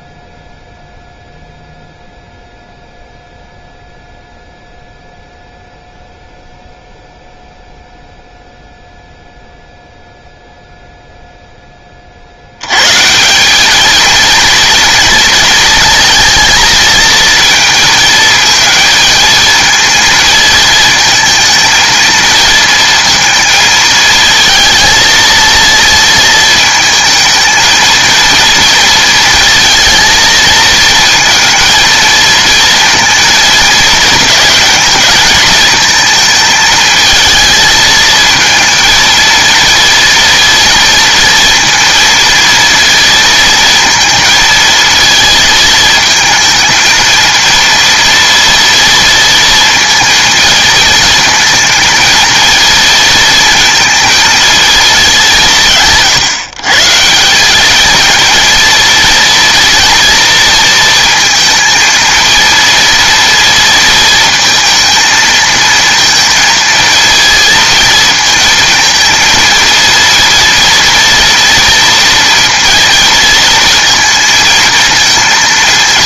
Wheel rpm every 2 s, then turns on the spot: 0, 0, 0, 0, 0, 0, 120, 230, 230, 220, 230, 230, 220, 220, 230, 230, 230, 220, 220, 230, 230, 230, 220, 230, 230, 220, 220, 210, 150, 230, 230, 230, 220, 230, 230, 230, 230, 230.
none